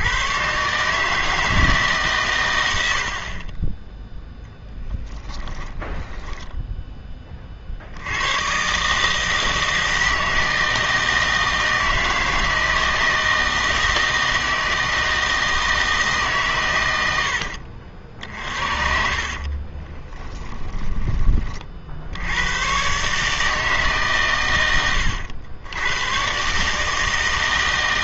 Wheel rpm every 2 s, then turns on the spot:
140, 90, 10, 10, 130, 160, 160, 160, 120, 50, 10, 110, 100, 150.
4-8 18-22